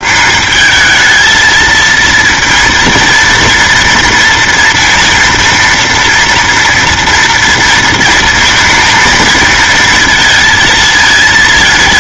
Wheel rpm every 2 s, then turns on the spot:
210, 230, 230, 230, 220, 230.
none